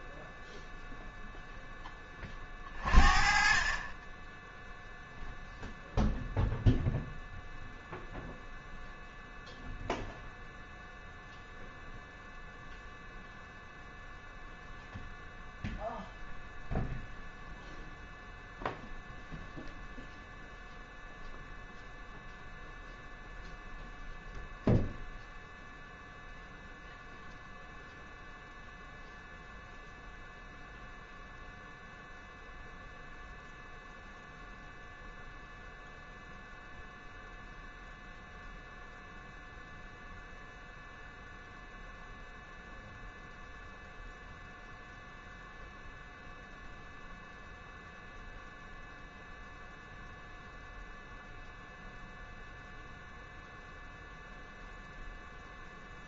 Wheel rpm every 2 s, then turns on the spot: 0, 40, 0, 0, 0, 0, 0, 0, 0, 0, 0, 0, 0, 0, 0, 0, 0, 0, 0, 0, 0, 0, 0, 0, 0, 0, 0, 0.
none